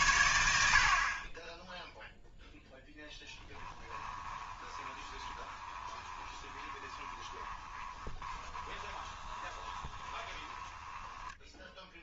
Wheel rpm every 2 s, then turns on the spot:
0, 20, 20, 20, 20, 10.
2-10